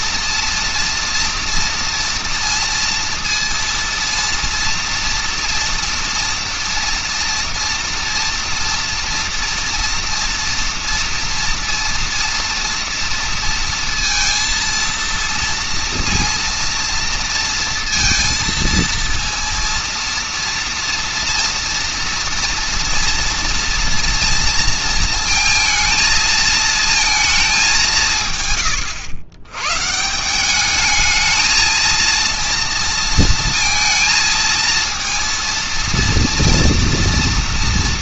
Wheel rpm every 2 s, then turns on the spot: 230, 230, 230, 230, 230, 230, 230, 230, 230, 230, 230, 230, 230, 220, 120, 210, 230, 230, 240.
none